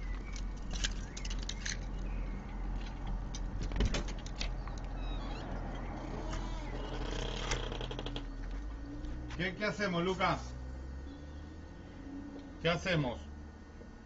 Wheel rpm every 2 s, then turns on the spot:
0, 0, 0, 0, 0, 0, 0.
none